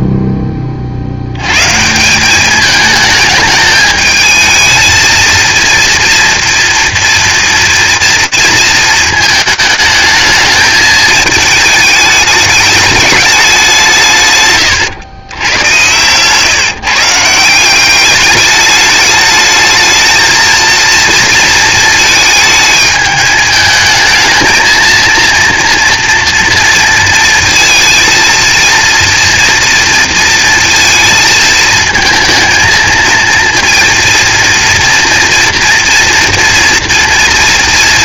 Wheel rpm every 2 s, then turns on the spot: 0, 150, 220, 230, 230, 220, 210, 150, 120, 210, 220, 220, 220, 230, 230, 230, 220, 230, 230.
16-18